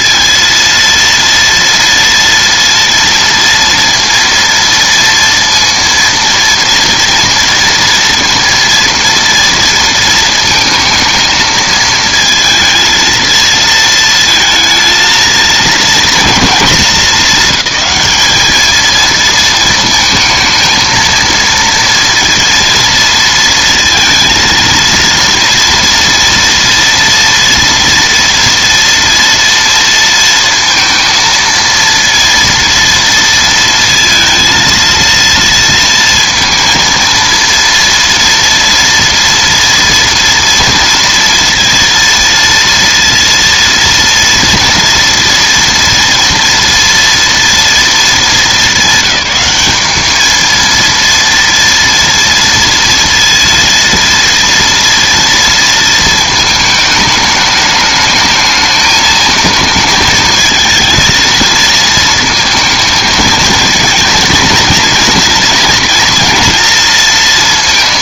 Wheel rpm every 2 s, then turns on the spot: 230, 230, 230, 230, 230, 220, 230, 230, 220, 220, 220, 230, 230, 230, 230, 230, 230, 230, 230, 230, 230, 230, 230, 230, 200, 230, 230, 230, 220, 220, 220, 230, 230, 230.
none